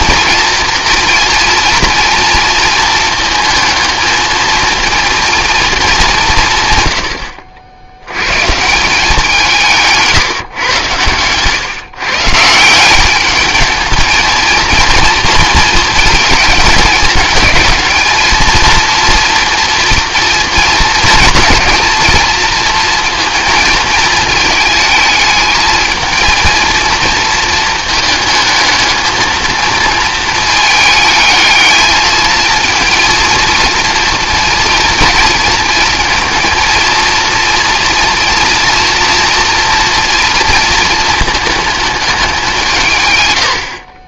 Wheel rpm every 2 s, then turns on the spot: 240, 230, 230, 130, 160, 120, 170, 230, 210, 230, 230, 230, 220, 230, 220, 220, 230, 230, 230, 240, 230, 160.
10-12